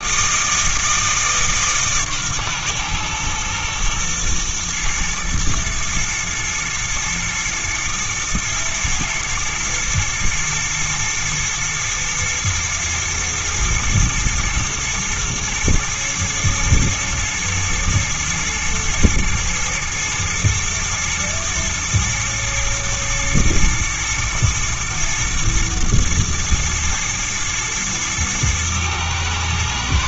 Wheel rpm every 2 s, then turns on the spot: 160, 120, 120, 120, 110, 110, 110, 110, 110, 110, 110, 120, 110, 120, 110.
none